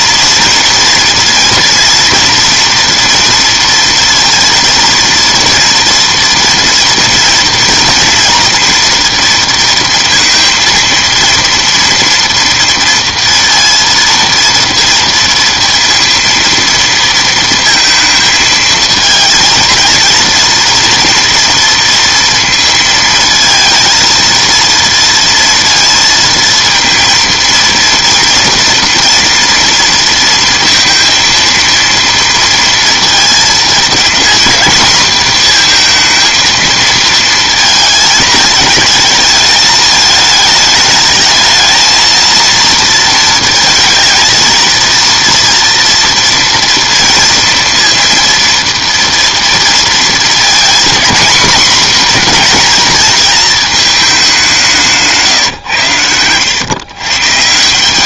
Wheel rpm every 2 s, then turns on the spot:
230, 240, 230, 230, 230, 230, 230, 230, 230, 220, 230, 230, 230, 230, 230, 230, 230, 230, 230, 220, 220, 230, 230, 230, 230, 230, 240, 180, 120.
none